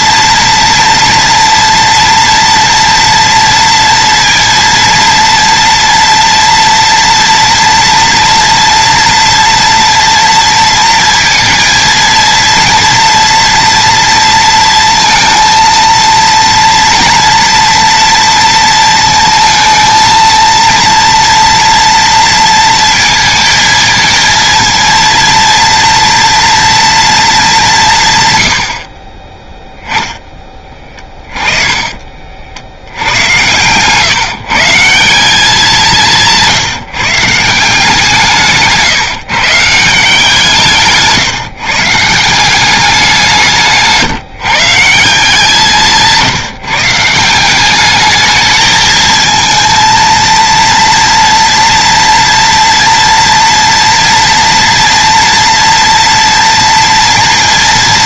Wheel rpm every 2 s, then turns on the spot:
230, 230, 230, 230, 230, 230, 230, 230, 230, 230, 230, 230, 230, 230, 80, 20, 70, 160, 150, 150, 160, 190, 160, 150, 220, 230, 230, 230, 230.
30-32